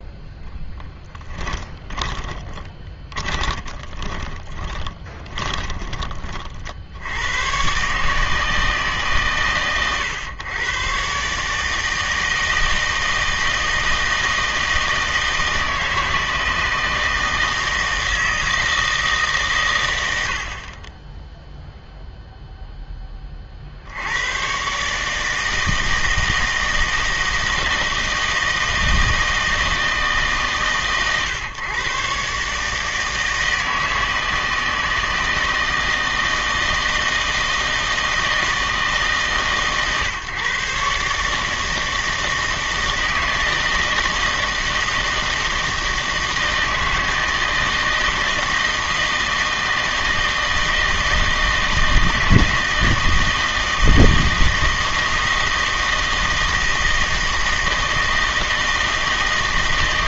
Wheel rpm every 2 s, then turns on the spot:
10, 20, 30, 60, 150, 120, 160, 160, 160, 160, 40, 10, 140, 160, 160, 140, 150, 160, 160, 160, 140, 160, 160, 160, 160, 160, 160, 160, 160, 160.
0-6